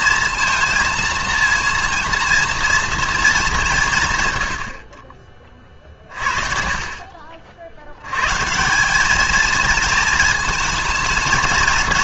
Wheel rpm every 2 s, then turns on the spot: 230, 230, 100, 40, 150, 220.
none